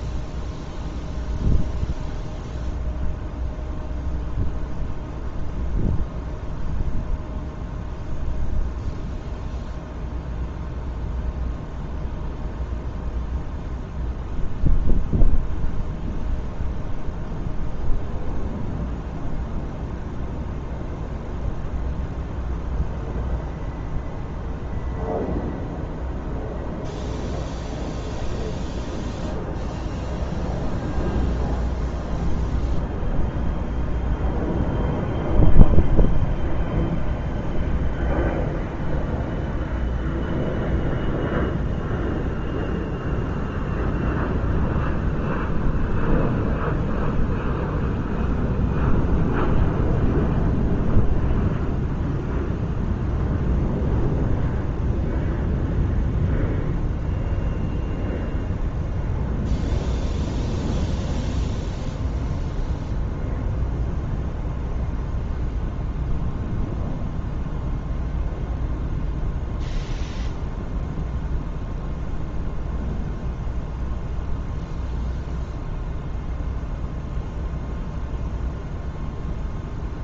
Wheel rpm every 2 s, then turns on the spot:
0, 0, 0, 0, 0, 0, 0, 0, 0, 0, 0, 0, 0, 0, 0, 0, 0, 0, 0, 0, 0, 0, 0, 0, 0, 0, 0, 0, 0, 0, 0, 0, 0, 0, 0, 0, 0, 0, 0, 0.
none